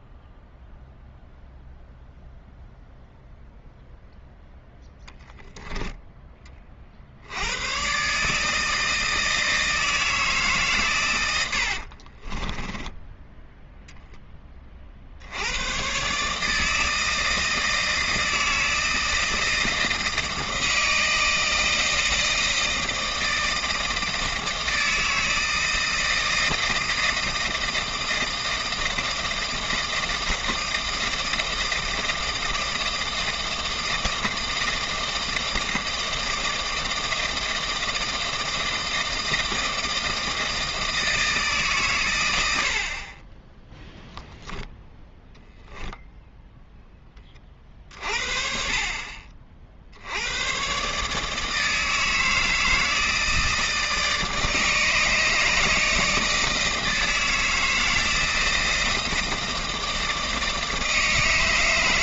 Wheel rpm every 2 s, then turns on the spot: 0, 0, 0, 20, 160, 150, 20, 30, 160, 160, 160, 160, 160, 160, 160, 160, 160, 160, 160, 160, 160, 80, 0, 0, 50, 110, 160, 150, 160, 160, 160.
12-14